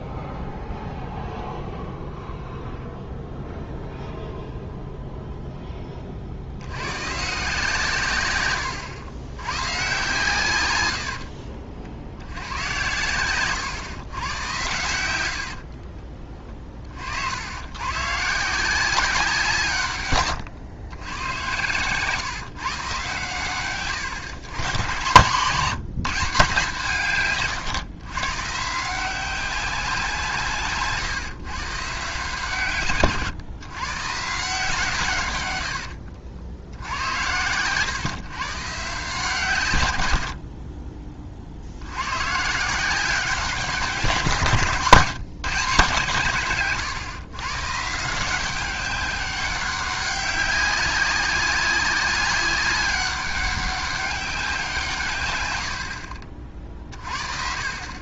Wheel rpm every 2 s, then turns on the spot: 0, 0, 0, 90, 100, 110, 110, 100, 40, 170, 110, 140, 120, 160, 150, 150, 140, 160, 80, 140, 50, 160, 160, 130, 190, 190, 190, 170, 40.
8-10 30-32